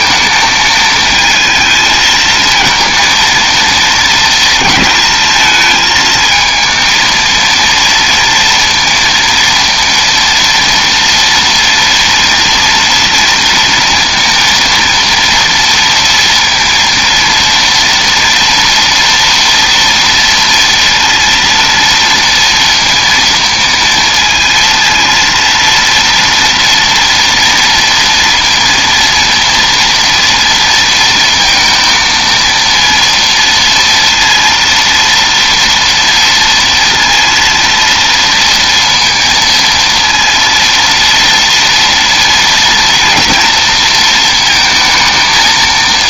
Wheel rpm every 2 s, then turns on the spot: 220, 230, 220, 220, 230, 230, 230, 230, 230, 240, 230, 230, 230, 230, 230, 230, 230, 230, 230, 230, 230, 230, 220.
none